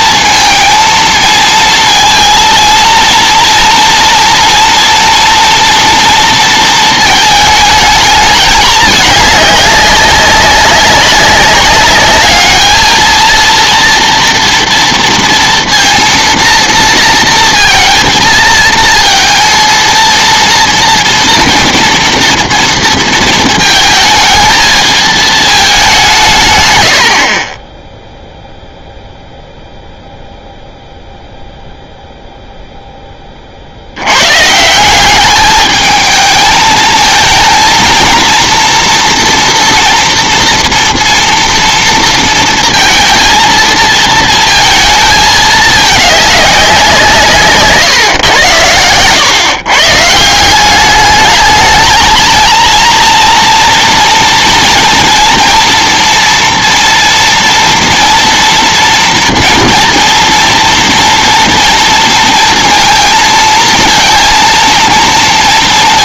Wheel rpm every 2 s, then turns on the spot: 230, 230, 230, 230, 210, 200, 210, 230, 230, 220, 230, 230, 220, 120, 0, 0, 0, 140, 220, 230, 230, 230, 230, 190, 110, 180, 230, 230, 230, 230, 240, 230, 230.
none